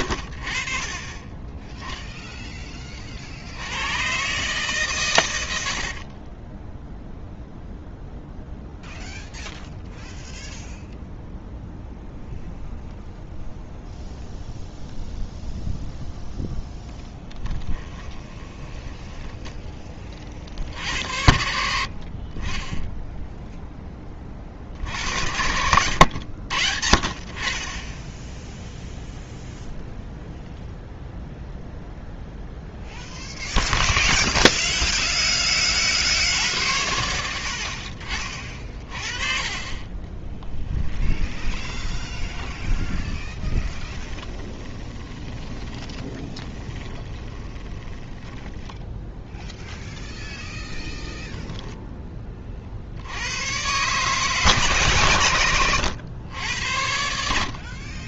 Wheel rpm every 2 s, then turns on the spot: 90, 50, 100, 30, 0, 0, 0, 0, 0, 10, 70, 10, 60, 60, 0, 0, 0, 0, 80, 30, 20, 20, 20, 20, 10, 0, 60, 130, 80.
6-8 18-20 40-50